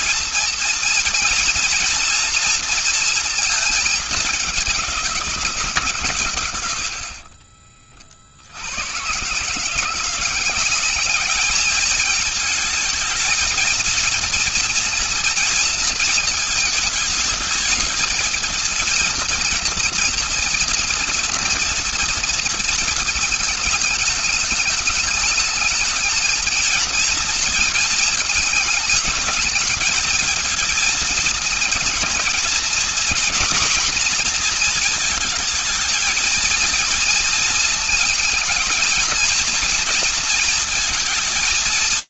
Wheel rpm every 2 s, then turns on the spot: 230, 220, 160, 50, 150, 210, 230, 230, 220, 230, 230, 220, 220, 230, 210, 220, 240, 220, 230, 230, 230.
6-8